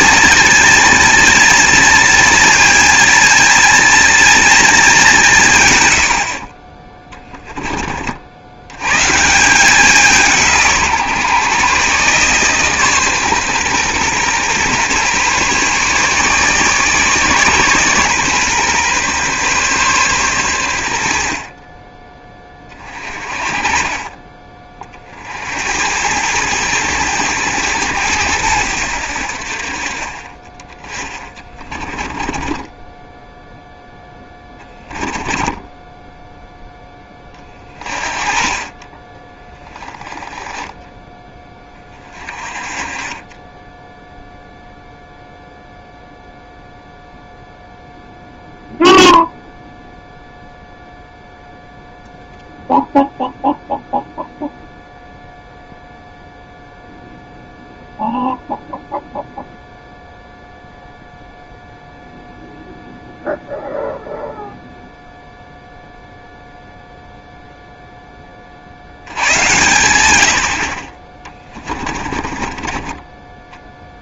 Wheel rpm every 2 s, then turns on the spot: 230, 230, 220, 30, 110, 160, 140, 130, 150, 130, 100, 30, 40, 110, 80, 20, 20, 10, 10, 30, 20, 30, 0, 0, 0, 0, 0, 0, 0, 0, 0, 0, 0, 0, 70, 50, 30.
32-36 72-74